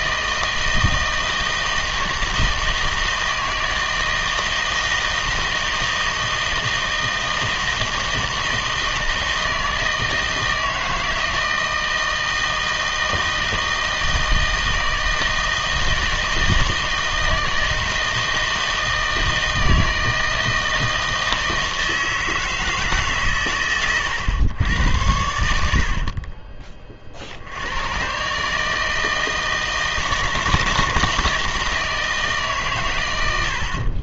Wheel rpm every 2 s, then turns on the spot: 160, 160, 160, 160, 160, 160, 160, 160, 160, 160, 160, 160, 100, 30, 150, 160, 130.
none